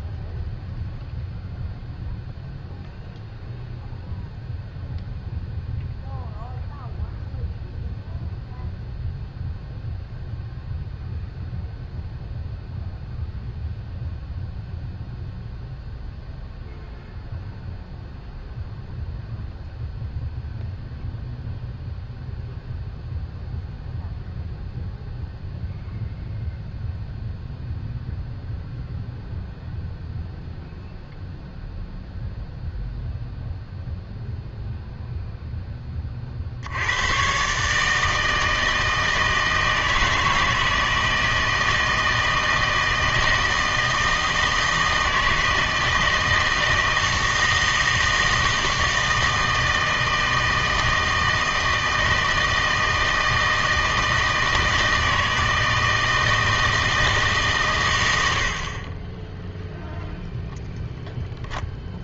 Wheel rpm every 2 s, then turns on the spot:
0, 0, 0, 0, 0, 0, 0, 0, 0, 0, 0, 0, 0, 0, 0, 0, 0, 0, 50, 160, 160, 160, 160, 160, 160, 160, 160, 160, 160, 80, 0.
none